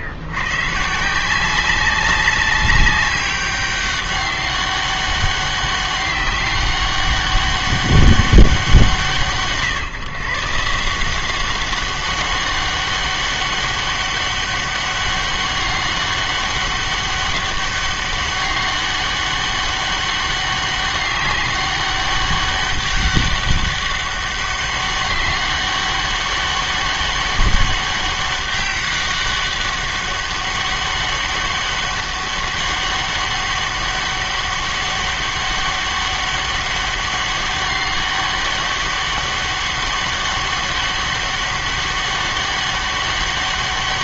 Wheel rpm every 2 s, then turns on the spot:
120, 190, 200, 200, 180, 150, 200, 200, 200, 200, 200, 200, 200, 200, 200, 200, 200, 200, 200, 200, 200, 200.
none